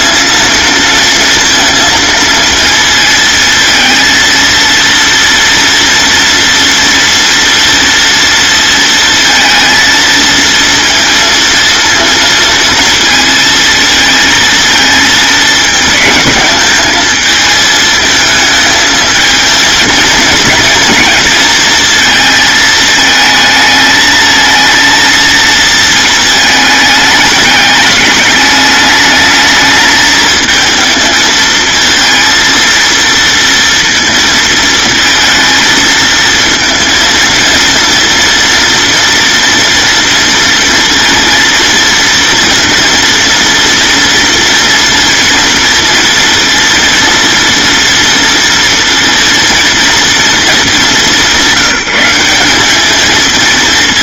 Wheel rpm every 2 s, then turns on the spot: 230, 230, 230, 240, 230, 230, 230, 230, 220, 220, 230, 220, 230, 210, 210, 220, 230, 220, 230, 240, 230, 230, 230, 230, 230, 200, 210.
none